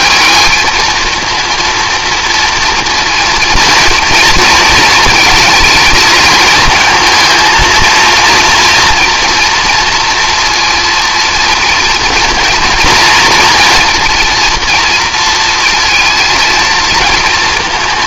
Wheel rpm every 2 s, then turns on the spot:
220, 230, 230, 220, 230, 230, 240, 230, 230.
none